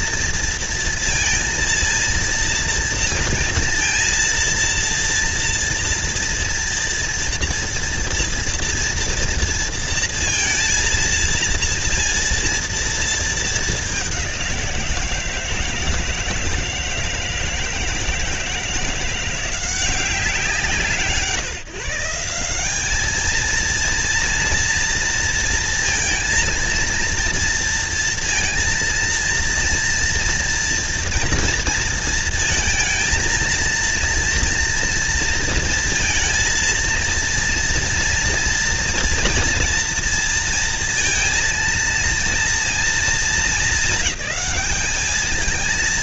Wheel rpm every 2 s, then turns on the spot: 230, 230, 230, 230, 230, 230, 230, 180, 160, 160, 150, 180, 230, 230, 230, 240, 230, 230, 230, 230, 230, 230, 210.
none